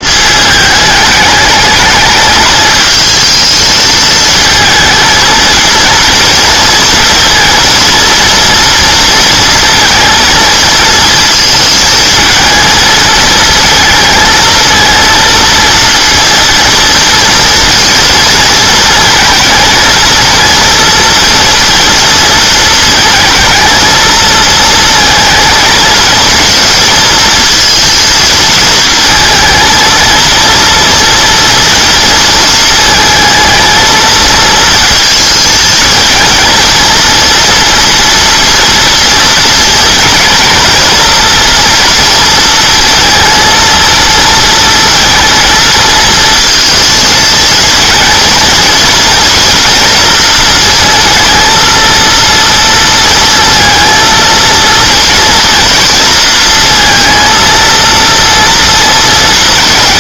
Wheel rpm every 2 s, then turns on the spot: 210, 220, 220, 230, 230, 230, 220, 230, 230, 230, 230, 220, 230, 230, 230, 230, 230, 230, 230, 230, 230, 230, 230, 220, 230, 230, 230, 230, 230, 230.
none